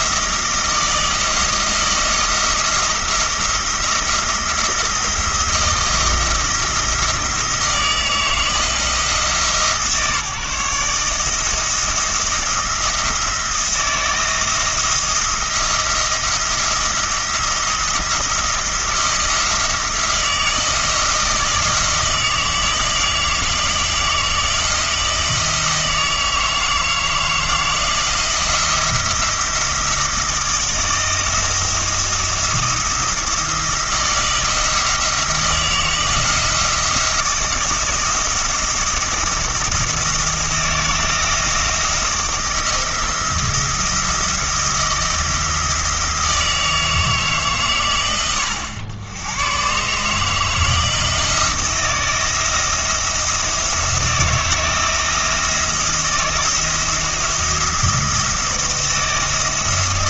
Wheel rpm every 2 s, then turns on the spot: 160, 160, 170, 170, 160, 150, 170, 170, 170, 170, 160, 160, 160, 160, 170, 160, 170, 170, 160, 170, 170, 160, 170, 160, 90, 160, 170, 170, 170, 170.
none